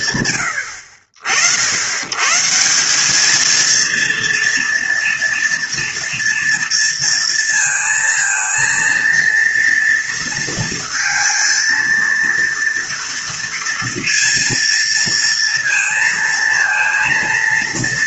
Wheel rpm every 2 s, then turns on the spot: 60, 200, 230, 230, 230, 230, 230, 230, 230.
none